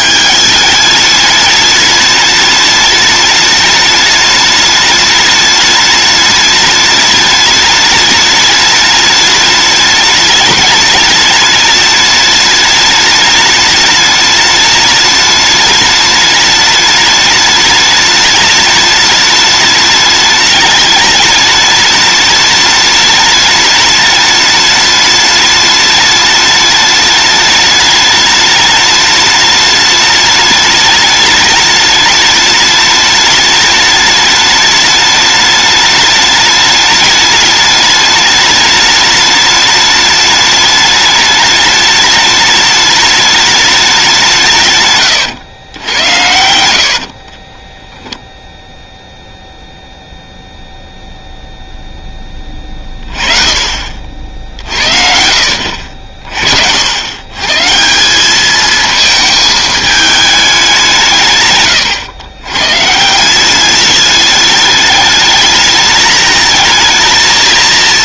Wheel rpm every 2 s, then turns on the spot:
210, 210, 210, 210, 210, 210, 210, 210, 210, 210, 210, 210, 210, 210, 210, 210, 210, 210, 210, 210, 210, 210, 120, 70, 0, 0, 30, 50, 80, 220, 180, 130, 210, 220.
46-48